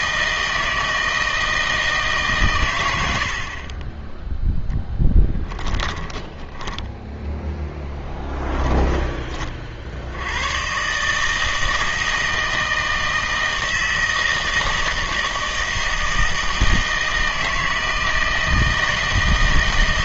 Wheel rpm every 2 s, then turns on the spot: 160, 120, 0, 10, 20, 120, 160, 160, 160, 160.
6-10